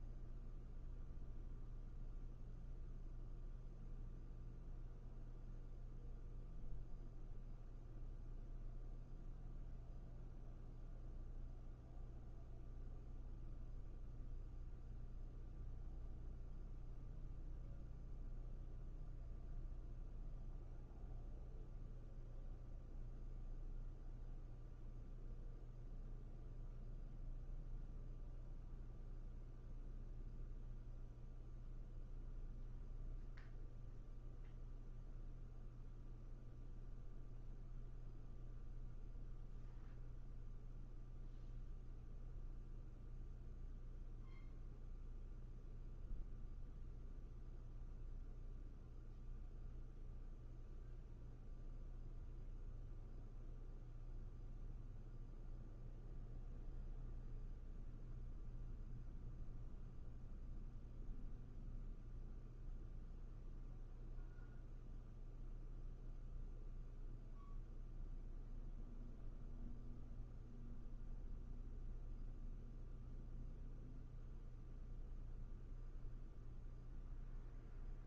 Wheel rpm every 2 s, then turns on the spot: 0, 0, 0, 0, 0, 0, 0, 0, 0, 0, 0, 0, 0, 0, 0, 0, 0, 0, 0, 0, 0, 0, 0, 0, 0, 0, 0, 0, 0, 0, 0, 0, 0, 0, 0, 0, 0, 0, 0.
none